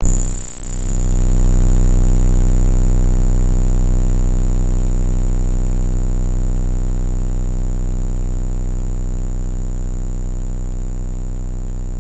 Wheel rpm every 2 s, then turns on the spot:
0, 0, 0, 0, 0, 0.
none